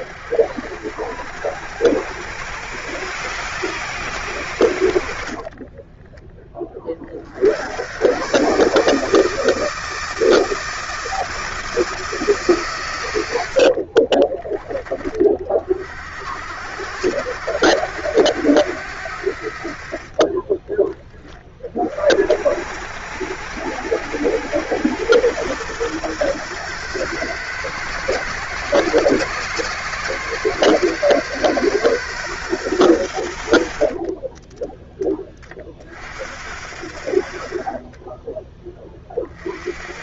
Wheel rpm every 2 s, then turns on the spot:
70, 110, 100, 30, 140, 160, 130, 20, 70, 90, 30, 70, 100, 120, 130, 130, 120, 10, 60, 20.
20-22 34-36